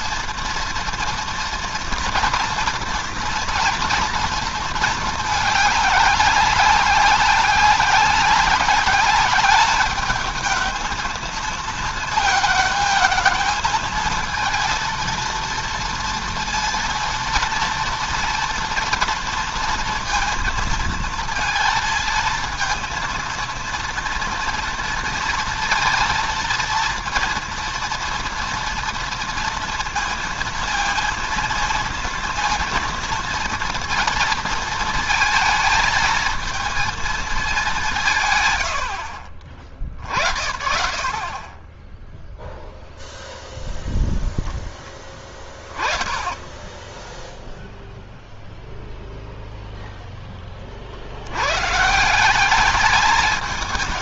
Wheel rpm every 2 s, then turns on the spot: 230, 230, 220, 190, 200, 220, 220, 230, 230, 230, 230, 230, 230, 230, 230, 230, 230, 230, 220, 100, 40, 0, 0, 0, 0, 50, 210.
none